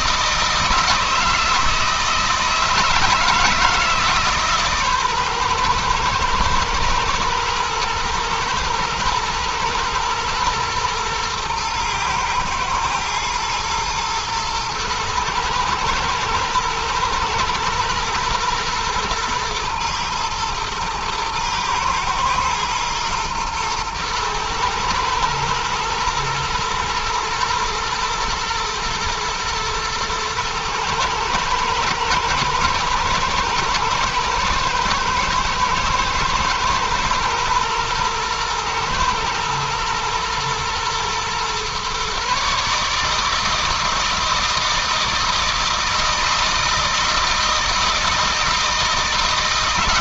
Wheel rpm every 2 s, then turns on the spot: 160, 160, 140, 120, 110, 120, 120, 110, 110, 120, 110, 110, 110, 110, 110, 110, 110, 110, 120, 110, 120, 150, 160, 160, 160.
none